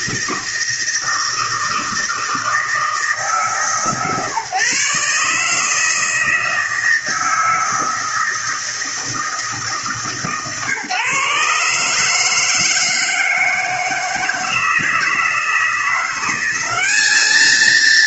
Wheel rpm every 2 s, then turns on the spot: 160, 160, 140, 160, 160, 150, 160, 160, 190.
none